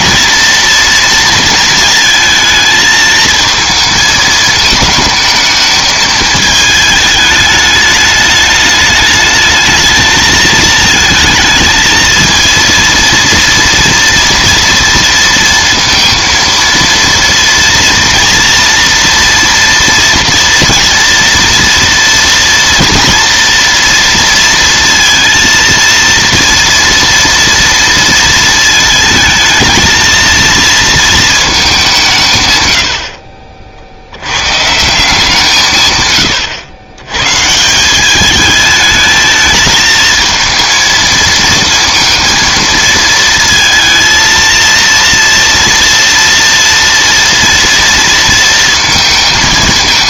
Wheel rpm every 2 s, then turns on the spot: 230, 220, 220, 220, 210, 220, 230, 230, 230, 230, 230, 230, 230, 230, 230, 230, 100, 150, 90, 220, 230, 230, 230, 230, 220.
none